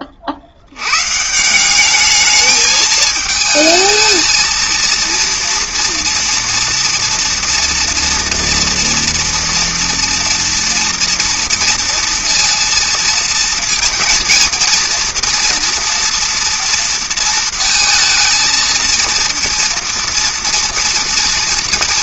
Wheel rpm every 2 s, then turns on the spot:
90, 220, 230, 230, 230, 230, 230, 230, 230, 230, 230.
none